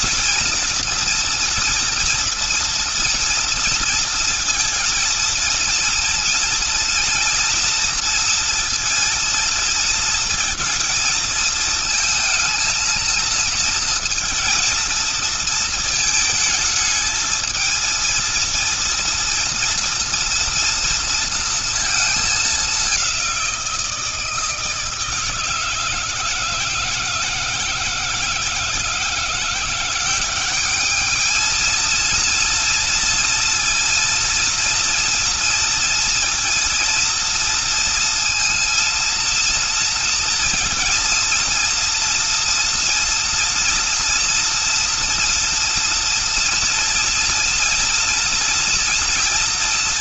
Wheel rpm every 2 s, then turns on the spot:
230, 240, 230, 240, 230, 220, 230, 230, 220, 230, 230, 190, 160, 160, 170, 210, 230, 230, 230, 230, 230, 230, 230, 230, 230.
none